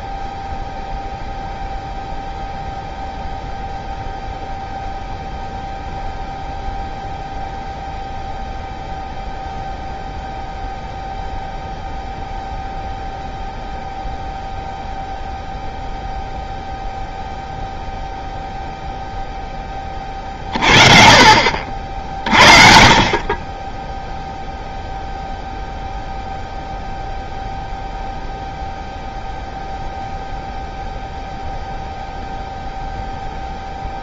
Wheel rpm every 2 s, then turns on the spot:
0, 0, 0, 0, 0, 0, 0, 0, 0, 0, 50, 40, 0, 0, 0, 0, 0.
none